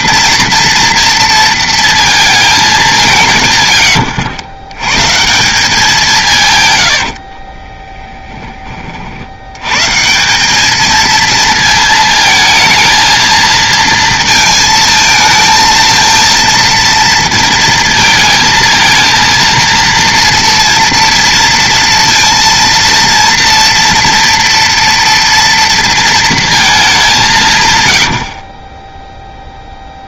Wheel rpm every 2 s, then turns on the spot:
230, 210, 120, 100, 30, 200, 220, 220, 230, 220, 230, 230, 240, 220, 20.
6-8 28-30